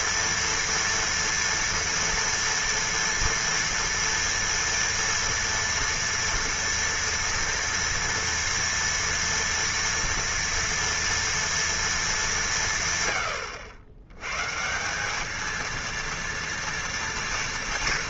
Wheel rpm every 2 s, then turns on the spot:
230, 230, 230, 230, 230, 230, 170, 140, 240.
none